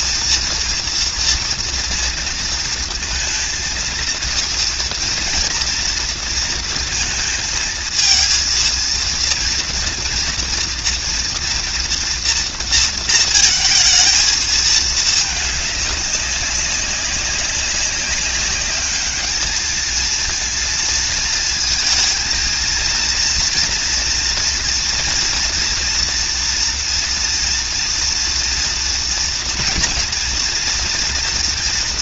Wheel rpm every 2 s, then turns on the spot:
230, 230, 230, 230, 230, 230, 230, 220, 200, 200, 220, 230, 230, 240, 230, 230.
none